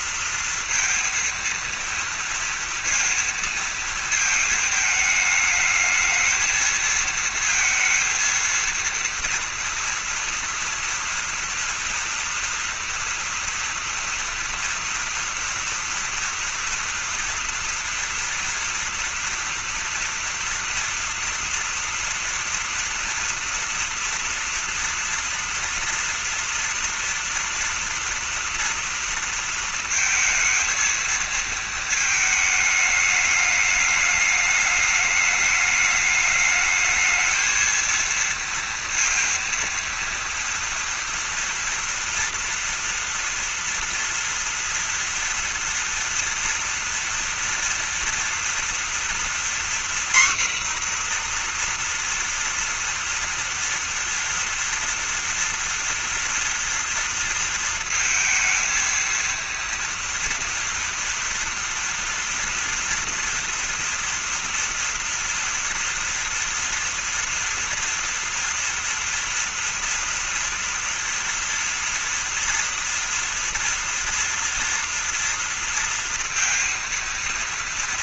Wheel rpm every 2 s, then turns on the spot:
230, 230, 220, 220, 230, 240, 230, 230, 230, 230, 230, 230, 240, 230, 230, 230, 220, 210, 220, 230, 230, 230, 230, 230, 230, 250, 230, 230, 230, 220, 240, 230, 230, 230, 230, 230, 230, 230, 230.
none